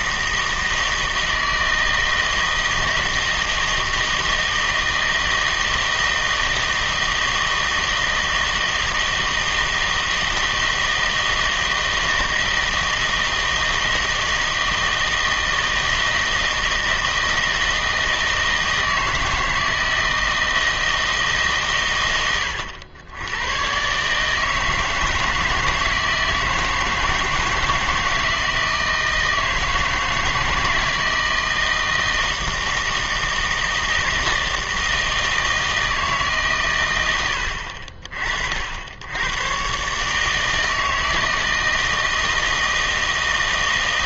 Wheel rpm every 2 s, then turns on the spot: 160, 160, 160, 160, 160, 160, 160, 160, 160, 160, 160, 110, 160, 160, 160, 160, 160, 160, 120, 70, 160, 160.
none